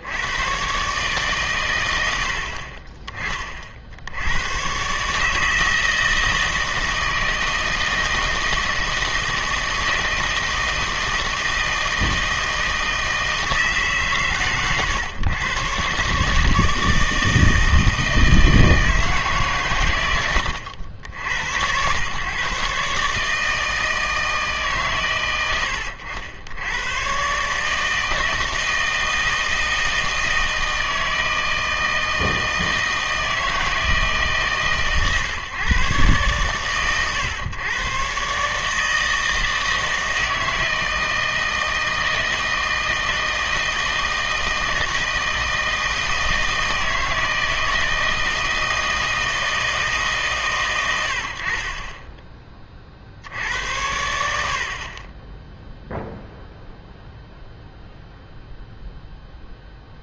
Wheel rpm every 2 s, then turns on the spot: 130, 40, 110, 160, 160, 160, 160, 110, 160, 160, 90, 140, 150, 100, 160, 160, 160, 140, 120, 150, 160, 160, 160, 160, 160, 120, 30, 70, 0, 0.
none